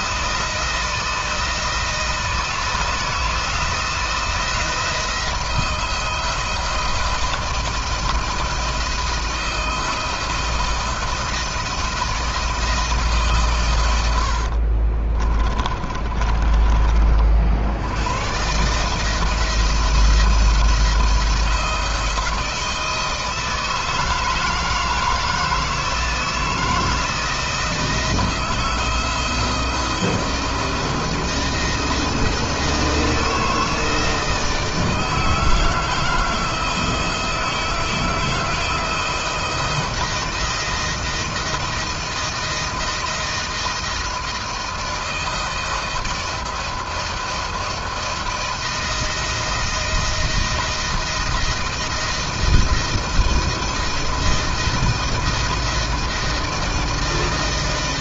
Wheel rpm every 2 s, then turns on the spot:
160, 160, 160, 170, 170, 170, 160, 40, 40, 150, 170, 170, 160, 170, 170, 170, 160, 160, 160, 170, 160, 160, 160, 170, 170, 160, 160, 160, 160.
14-16